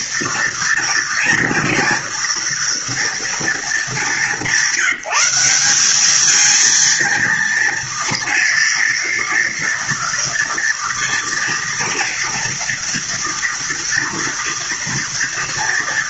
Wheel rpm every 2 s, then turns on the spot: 230, 230, 180, 220, 230, 230, 230, 240.
none